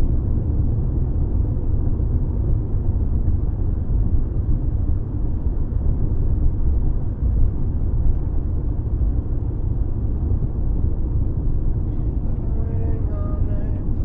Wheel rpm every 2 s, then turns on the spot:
0, 0, 0, 0, 0, 0, 0.
none